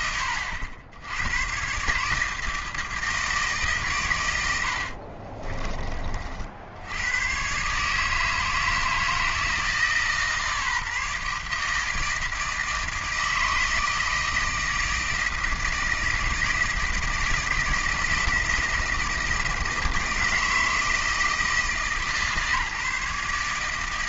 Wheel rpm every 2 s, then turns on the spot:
80, 160, 80, 70, 160, 160, 160, 160, 160, 160, 160, 150.
4-6